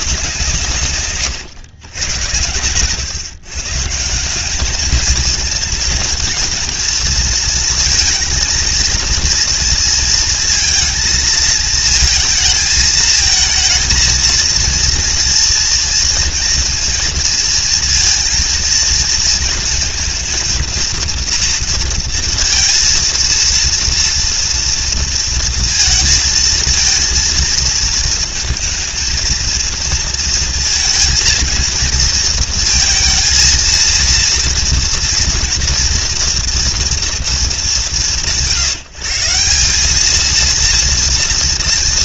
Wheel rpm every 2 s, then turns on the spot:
140, 110, 220, 220, 230, 220, 230, 230, 230, 230, 230, 230, 230, 230, 220, 230, 230, 230, 240, 150, 230.
none